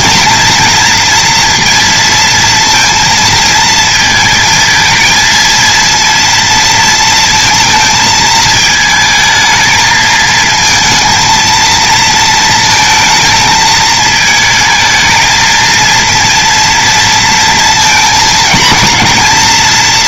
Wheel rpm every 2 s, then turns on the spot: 230, 230, 220, 230, 220, 230, 230, 220, 230, 230.
none